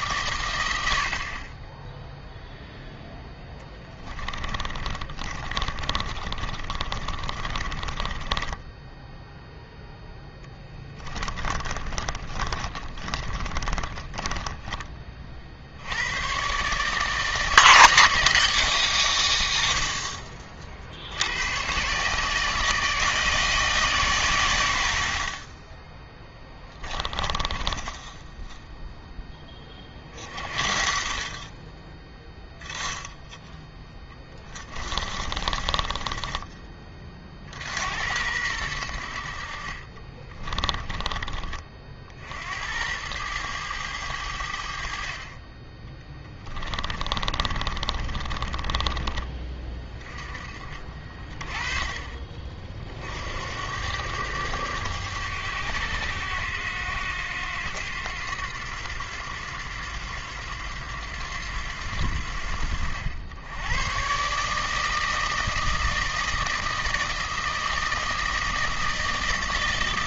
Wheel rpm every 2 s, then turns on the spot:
80, 0, 30, 30, 10, 10, 30, 20, 140, 110, 50, 160, 90, 20, 0, 40, 0, 20, 20, 90, 30, 90, 60, 30, 30, 40, 50, 100, 90, 90, 90, 70, 150, 160, 160.
4-10 12-14 26-28 34-36 40-42 46-50